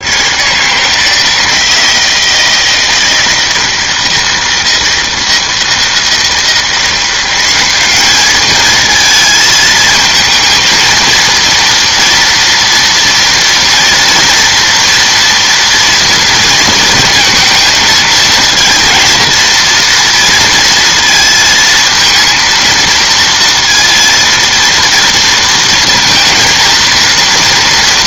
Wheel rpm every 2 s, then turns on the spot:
150, 160, 160, 170, 220, 230, 230, 230, 230, 230, 230, 230, 230, 230.
none